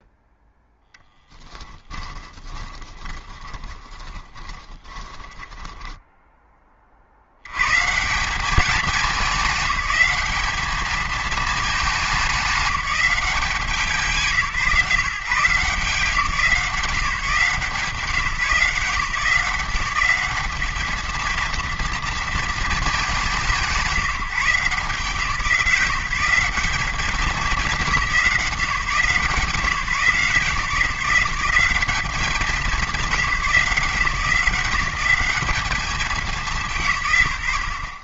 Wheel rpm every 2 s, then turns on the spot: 0, 20, 20, 30, 200, 210, 200, 160, 170, 160, 220, 220, 170, 200, 160, 160, 190, 190, 160.
2-6